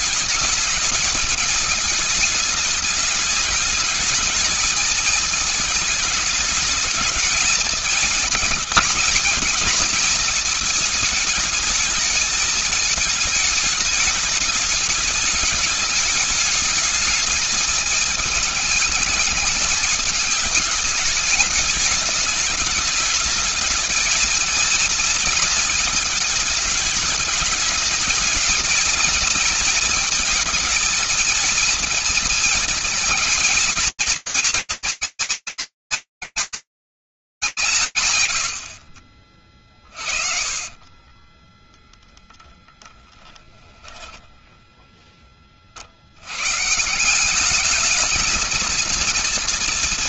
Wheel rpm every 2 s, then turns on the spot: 210, 210, 220, 210, 220, 220, 220, 210, 220, 220, 220, 210, 220, 210, 220, 220, 220, 230, 190, 50, 20, 10, 60, 210, 230.
38-42